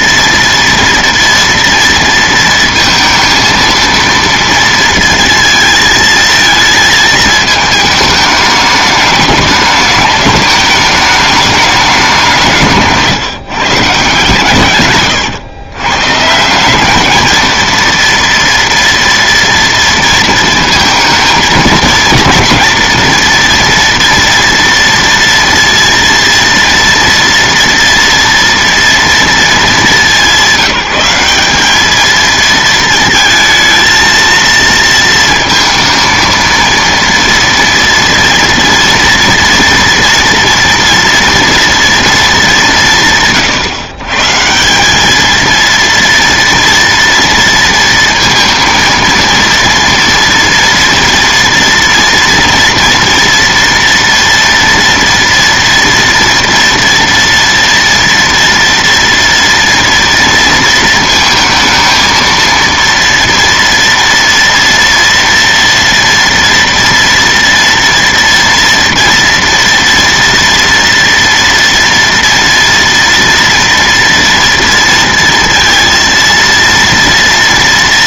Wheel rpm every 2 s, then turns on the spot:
230, 230, 230, 220, 210, 210, 160, 130, 180, 230, 230, 230, 230, 230, 230, 190, 230, 230, 230, 230, 230, 200, 170, 230, 230, 230, 230, 230, 230, 240, 230, 230, 230, 230, 230, 230, 230, 230, 230.
none